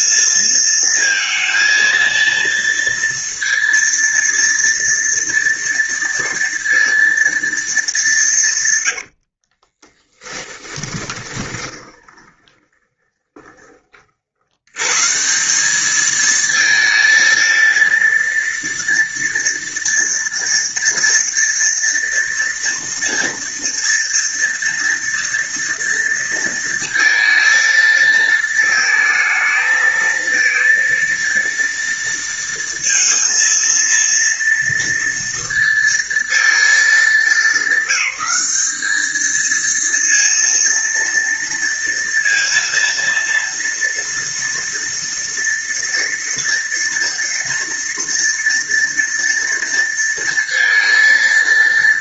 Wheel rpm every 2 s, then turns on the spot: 230, 230, 230, 230, 180, 10, 20, 60, 220, 230, 230, 230, 230, 230, 220, 220, 230, 230, 220, 200, 230, 230, 230, 230, 230, 230.
10-14